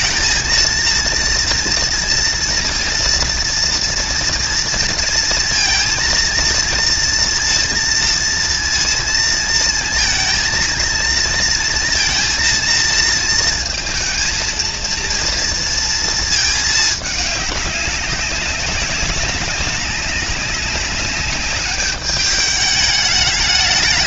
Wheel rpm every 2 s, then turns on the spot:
230, 230, 230, 230, 230, 230, 230, 230, 220, 190, 190, 210.
none